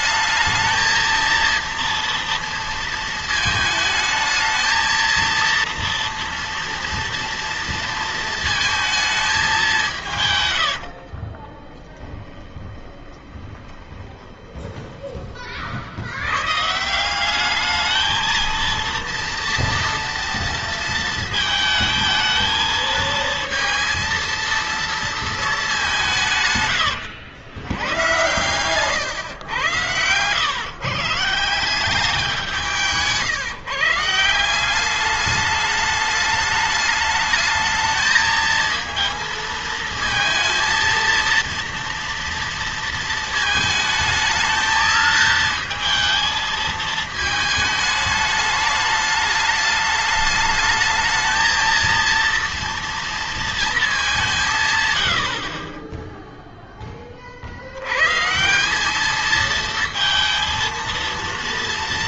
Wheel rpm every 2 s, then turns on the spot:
220, 230, 220, 230, 220, 100, 10, 20, 130, 230, 230, 220, 230, 120, 120, 130, 170, 180, 210, 220, 230, 230, 220, 220, 210, 210, 230, 160, 10, 170, 230.
10-16 26-28